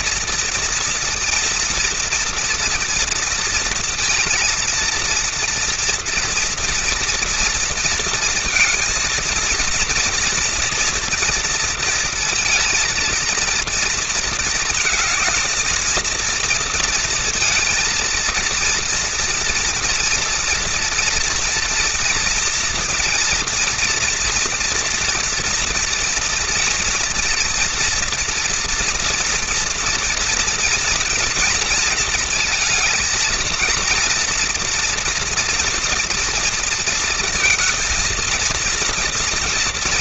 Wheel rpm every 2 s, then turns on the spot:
230, 230, 230, 230, 230, 230, 230, 230, 220, 230, 240, 240, 230, 240, 240, 230, 230, 230, 230, 230.
none